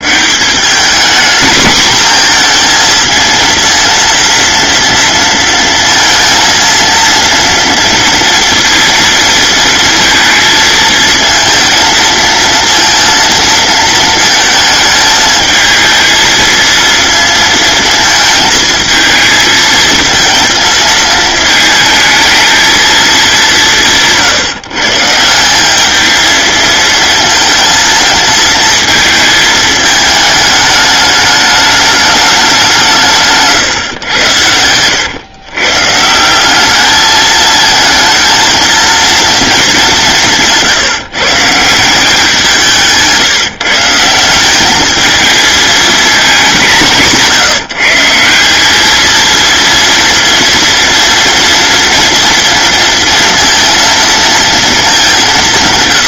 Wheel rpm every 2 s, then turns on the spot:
210, 230, 230, 230, 230, 220, 230, 220, 230, 220, 230, 220, 150, 220, 220, 220, 190, 100, 200, 230, 160, 170, 210, 190, 200, 230, 230, 230.
none